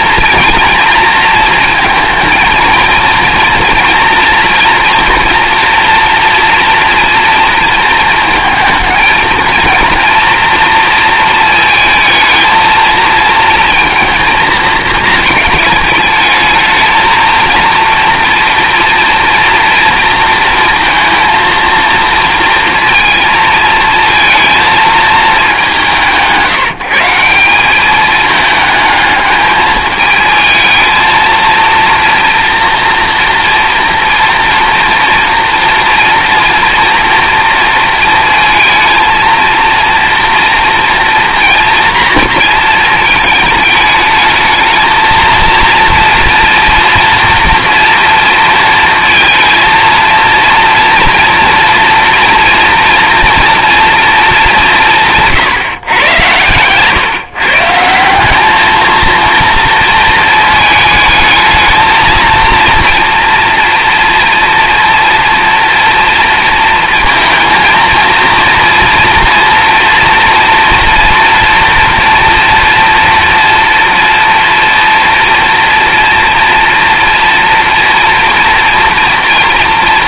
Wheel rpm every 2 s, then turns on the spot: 230, 220, 230, 230, 220, 230, 220, 220, 220, 230, 230, 230, 230, 170, 220, 220, 230, 230, 230, 230, 230, 230, 220, 230, 230, 230, 230, 190, 120, 210, 220, 230, 230, 230, 230, 230, 230, 240, 230, 230.
none